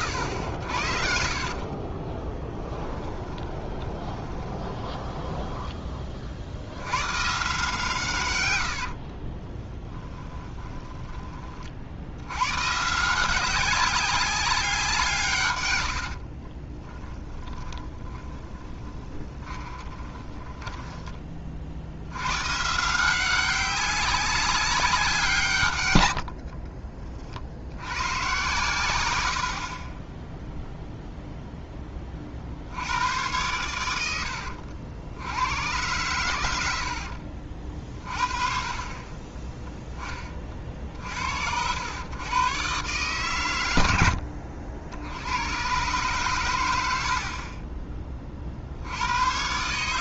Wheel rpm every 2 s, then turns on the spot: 70, 20, 20, 90, 80, 10, 140, 180, 20, 10, 20, 150, 190, 30, 120, 0, 80, 80, 80, 30, 40, 130, 80, 100, 70.
2-6 8-12 16-22 26-28 36-38